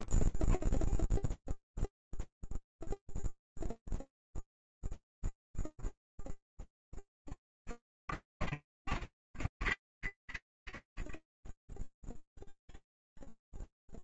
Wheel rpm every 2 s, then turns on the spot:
0, 0, 0, 0, 0, 0, 0.
none